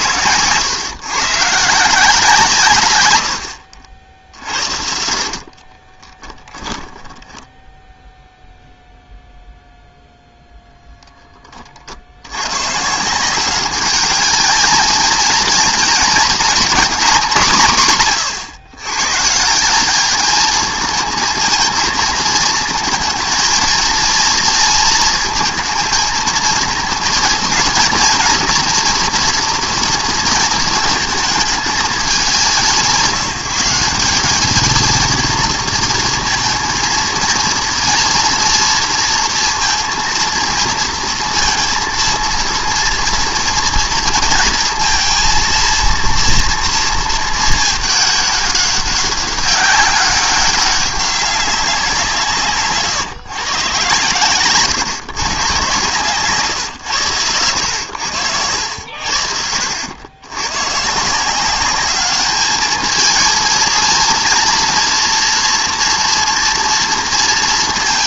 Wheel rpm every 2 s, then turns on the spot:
120, 130, 60, 10, 0, 0, 130, 220, 230, 120, 220, 230, 230, 230, 240, 230, 180, 220, 230, 230, 230, 230, 230, 230, 200, 190, 140, 130, 130, 80, 130, 210, 240, 230.
4-8 52-54